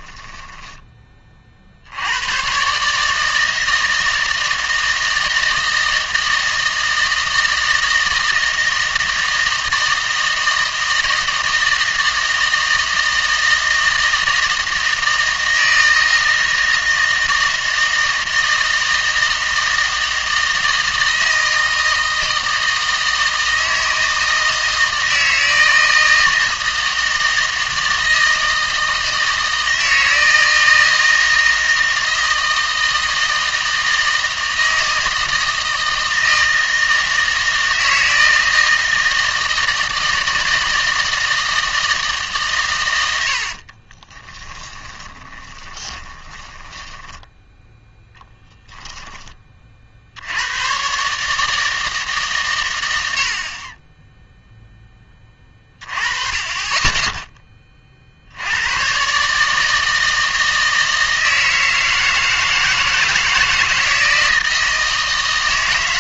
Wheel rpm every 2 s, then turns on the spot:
20, 130, 160, 160, 160, 160, 160, 160, 160, 160, 160, 160, 160, 160, 160, 160, 160, 160, 160, 160, 160, 120, 10, 10, 20, 110, 110, 10, 20, 100, 160, 160, 160.
44-48